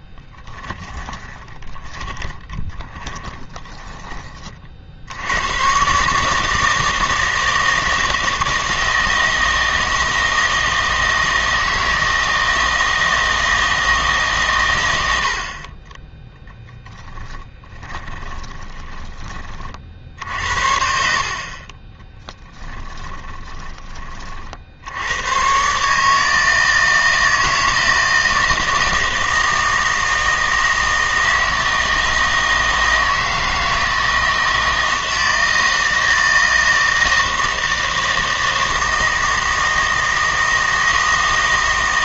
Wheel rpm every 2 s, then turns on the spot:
20, 20, 40, 160, 160, 160, 160, 120, 10, 20, 70, 10, 60, 160, 160, 160, 160, 160, 160, 160, 160.
0-4 18-20 22-24